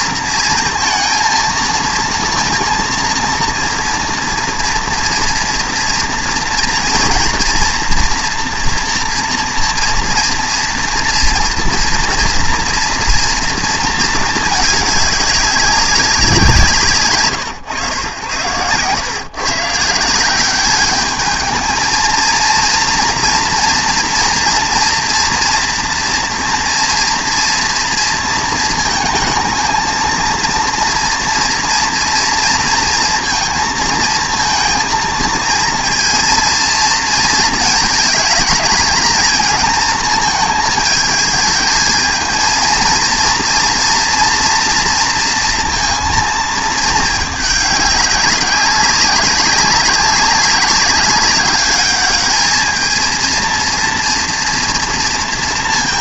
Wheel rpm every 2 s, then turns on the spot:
220, 230, 230, 230, 230, 230, 230, 210, 160, 100, 200, 230, 230, 230, 230, 230, 230, 230, 230, 210, 220, 230, 230, 220, 200, 190, 220, 230.
none